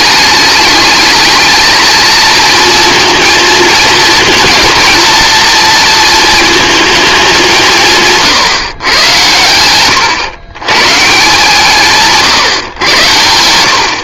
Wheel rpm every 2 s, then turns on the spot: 210, 230, 230, 220, 120, 130, 130.
none